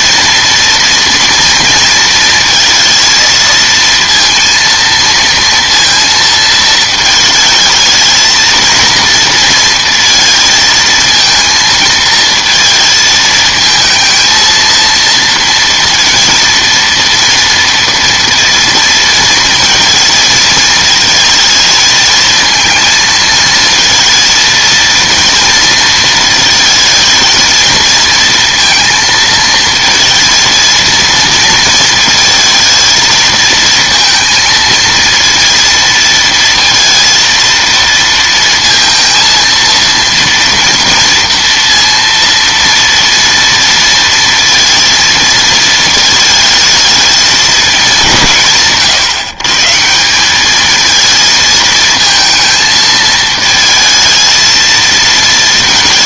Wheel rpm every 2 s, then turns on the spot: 230, 230, 230, 220, 230, 220, 220, 230, 230, 230, 220, 230, 230, 220, 230, 230, 220, 230, 230, 230, 230, 230, 230, 220, 140, 210, 220, 220.
none